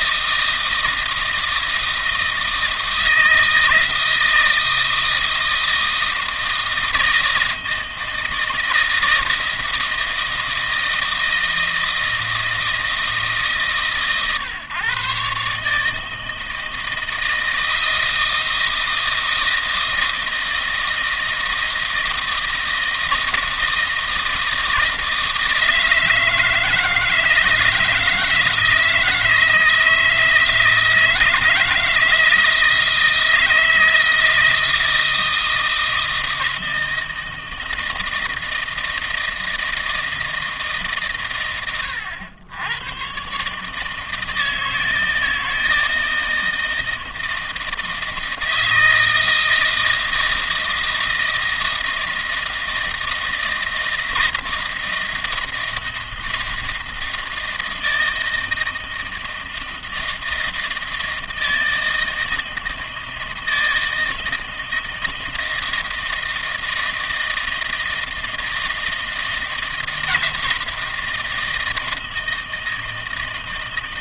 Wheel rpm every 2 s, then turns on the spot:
160, 160, 160, 160, 160, 160, 160, 130, 160, 160, 160, 160, 160, 160, 160, 160, 160, 160, 160, 160, 130, 110, 160, 160, 160, 160, 160, 160, 160, 160, 160, 160, 160, 160, 160, 160, 160.
none